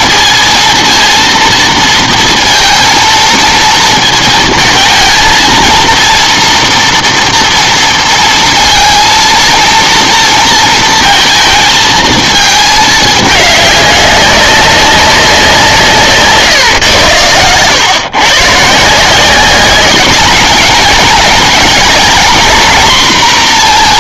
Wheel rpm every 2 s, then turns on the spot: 230, 230, 220, 240, 230, 230, 220, 190, 120, 150, 220, 240.
none